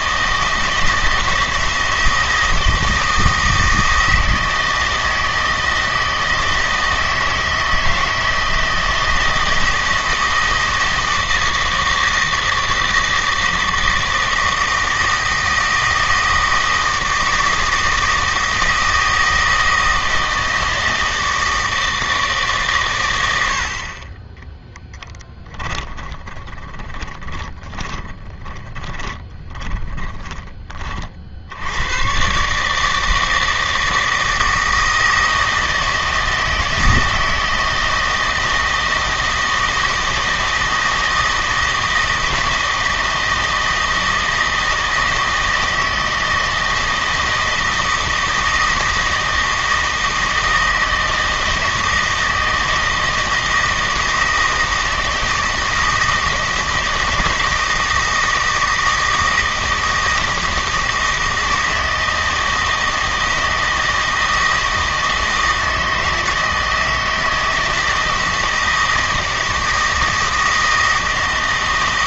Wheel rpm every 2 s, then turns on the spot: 160, 170, 160, 160, 160, 160, 160, 160, 160, 160, 160, 140, 10, 20, 20, 30, 150, 160, 160, 160, 160, 160, 160, 160, 160, 160, 160, 160, 160, 160, 160, 160, 160, 160, 160, 160.
24-30